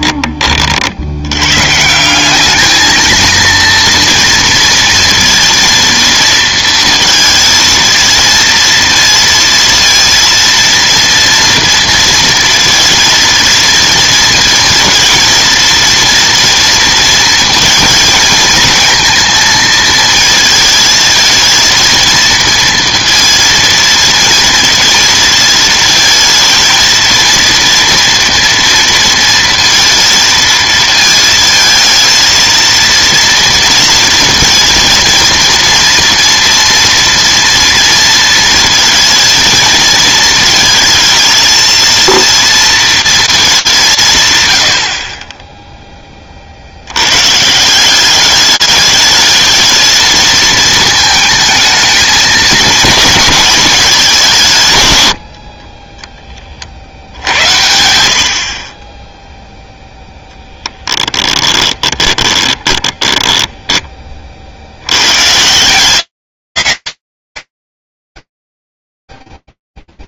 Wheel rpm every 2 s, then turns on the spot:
30, 200, 230, 230, 230, 230, 230, 230, 230, 230, 230, 230, 230, 230, 230, 230, 230, 230, 230, 230, 230, 230, 110, 50, 210, 220, 220, 160, 40, 40, 10, 20, 70, 70, 0.
60-64